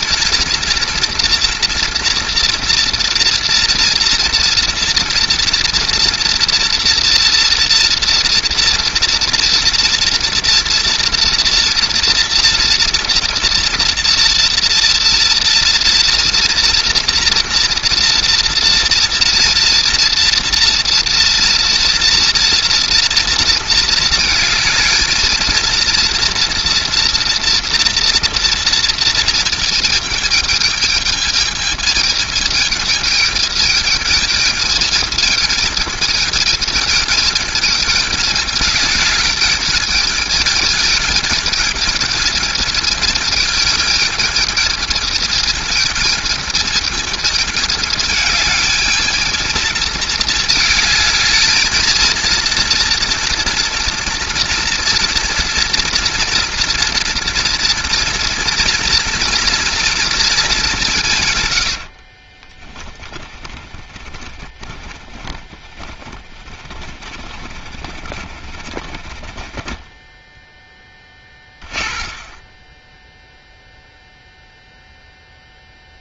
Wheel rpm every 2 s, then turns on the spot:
230, 230, 230, 240, 230, 230, 230, 230, 230, 230, 240, 240, 220, 230, 230, 220, 220, 220, 220, 210, 220, 220, 220, 220, 210, 220, 230, 240, 230, 230, 210, 20, 30, 30, 40, 10, 20, 0.
62-74